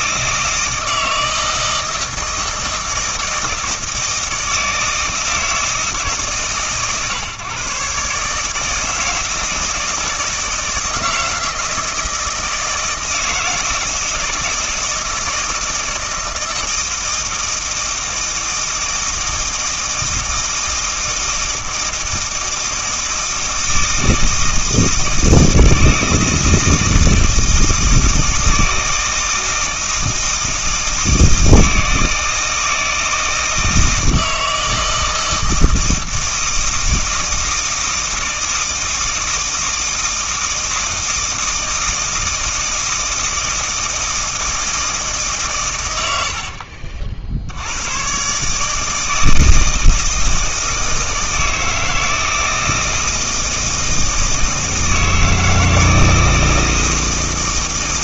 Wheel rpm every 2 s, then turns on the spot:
160, 160, 160, 130, 160, 160, 160, 160, 160, 160, 160, 160, 160, 160, 160, 160, 160, 160, 160, 160, 160, 160, 160, 60, 160, 160, 160, 160, 160.
none